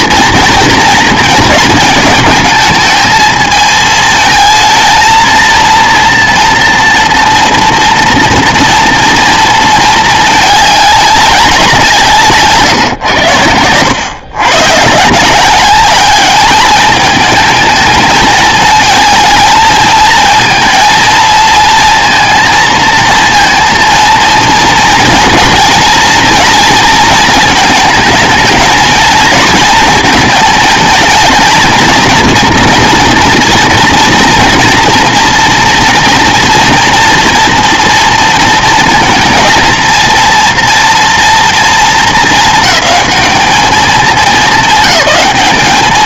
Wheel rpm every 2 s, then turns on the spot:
230, 210, 230, 230, 230, 210, 130, 130, 210, 220, 230, 230, 230, 230, 230, 220, 230, 230, 230, 230, 230, 230, 220.
12-14